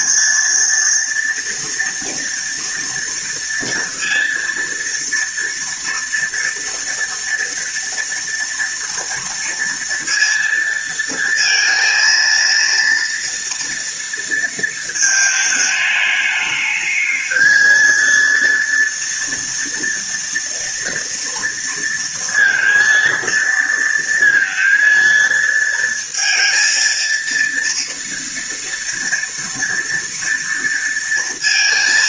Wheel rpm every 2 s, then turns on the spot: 230, 230, 230, 230, 230, 230, 230, 220, 220, 230, 230, 230, 230, 230, 230, 230.
none